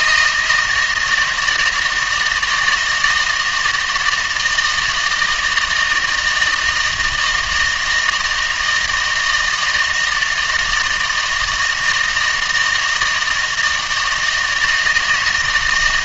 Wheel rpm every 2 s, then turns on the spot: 160, 160, 160, 160, 160, 160, 160, 160.
none